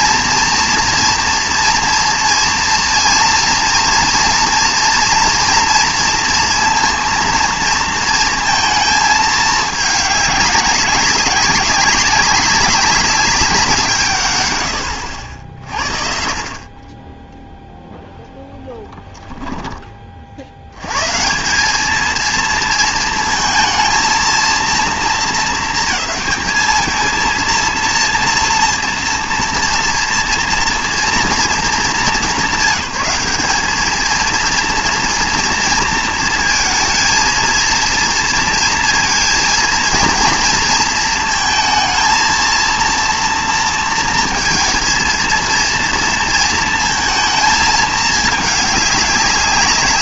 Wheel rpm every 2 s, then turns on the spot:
230, 230, 230, 230, 220, 200, 190, 120, 40, 10, 90, 230, 230, 220, 230, 230, 200, 230, 230, 230, 230, 230, 230, 230, 210.
18-20